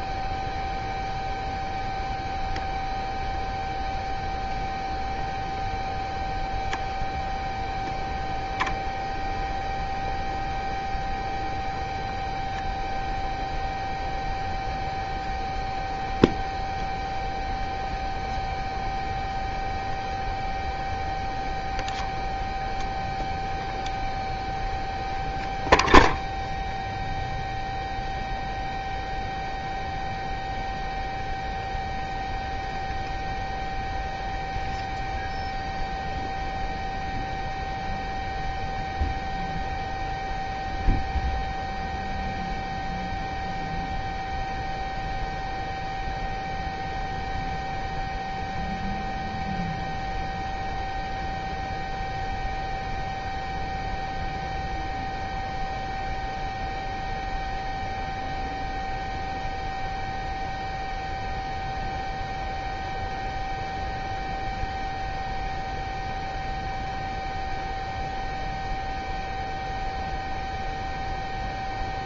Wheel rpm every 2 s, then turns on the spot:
0, 0, 0, 0, 0, 0, 0, 0, 0, 0, 0, 0, 0, 0, 0, 0, 0, 0, 0, 0, 0, 0, 0, 0, 0, 0, 0, 0, 0, 0, 0, 0, 0, 0, 0, 0.
none